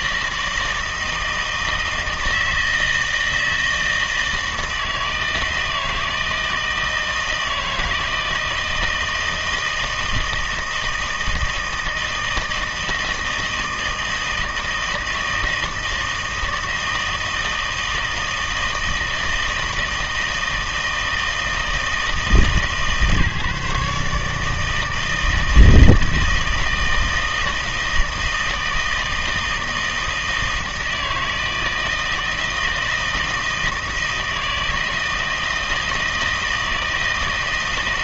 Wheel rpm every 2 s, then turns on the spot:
160, 160, 160, 160, 160, 160, 160, 160, 160, 160, 160, 150, 160, 160, 160, 160, 160, 160, 160.
none